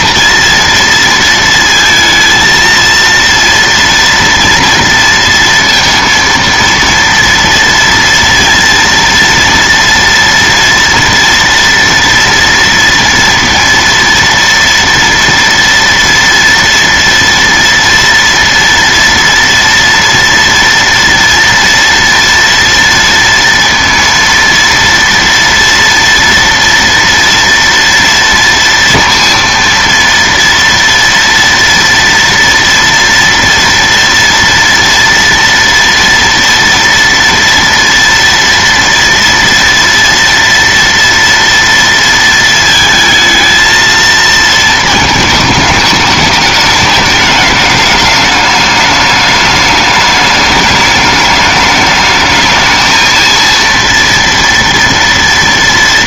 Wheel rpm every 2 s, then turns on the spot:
230, 230, 230, 230, 230, 230, 230, 240, 230, 230, 230, 230, 230, 230, 230, 230, 230, 230, 240, 230, 230, 220, 220, 210, 210, 210, 220, 240.
none